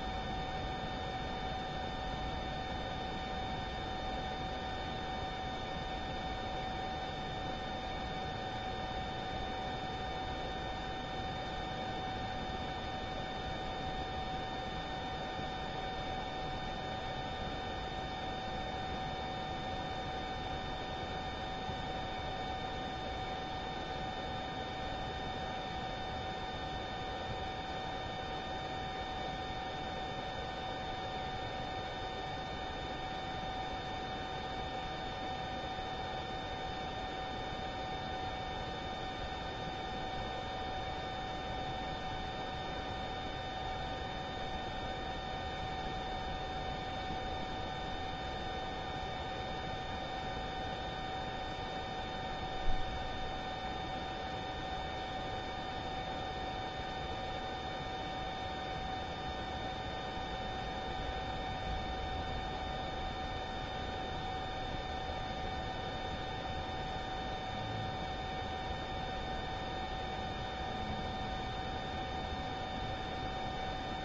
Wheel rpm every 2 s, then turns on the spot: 0, 0, 0, 0, 0, 0, 0, 0, 0, 0, 0, 0, 0, 0, 0, 0, 0, 0, 0, 0, 0, 0, 0, 0, 0, 0, 0, 0, 0, 0, 0, 0, 0, 0, 0, 0, 0.
none